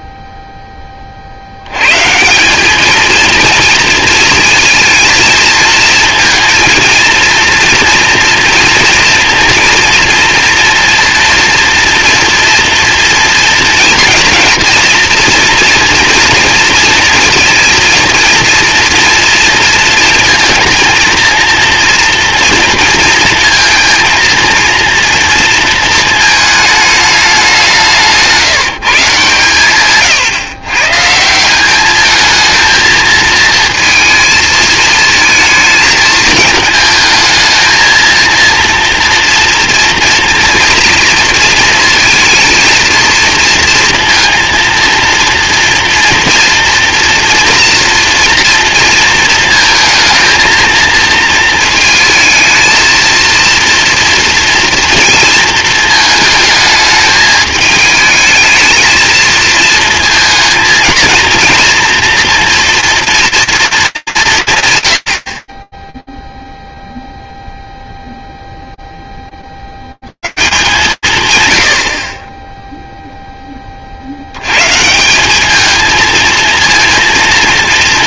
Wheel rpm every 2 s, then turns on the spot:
0, 190, 230, 230, 230, 230, 230, 230, 230, 230, 230, 230, 230, 220, 170, 120, 220, 220, 220, 230, 230, 230, 230, 240, 230, 230, 220, 230, 220, 220, 220, 230, 150, 0, 0, 140, 60, 70, 230.
none